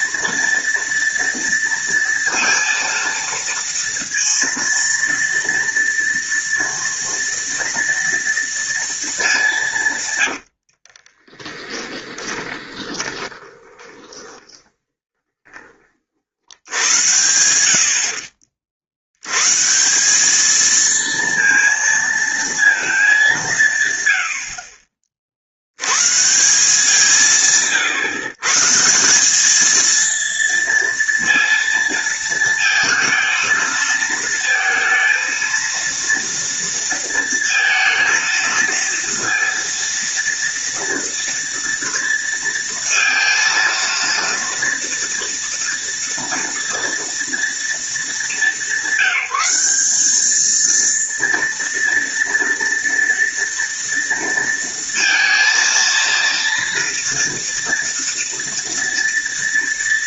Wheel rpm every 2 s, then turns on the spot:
230, 230, 230, 230, 230, 60, 10, 20, 80, 50, 220, 230, 60, 170, 150, 230, 230, 230, 230, 230, 230, 230, 230, 230, 180, 220, 230, 230, 230, 230.
10-16